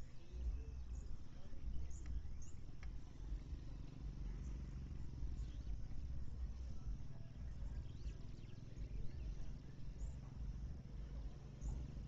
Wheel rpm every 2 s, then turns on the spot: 0, 0, 0, 0, 0, 0.
none